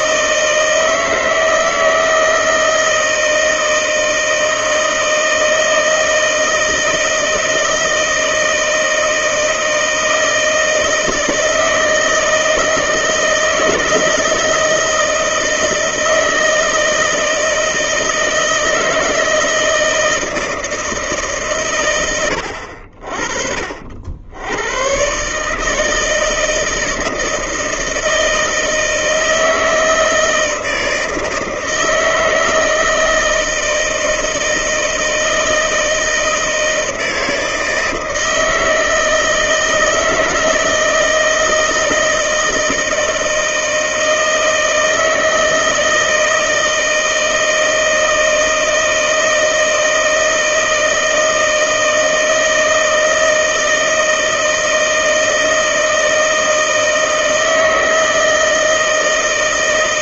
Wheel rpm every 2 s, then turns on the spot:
160, 160, 160, 160, 160, 160, 160, 160, 160, 160, 160, 80, 100, 160, 160, 160, 160, 160, 160, 160, 160, 160, 160, 160, 160, 160, 160, 160, 160, 160.
none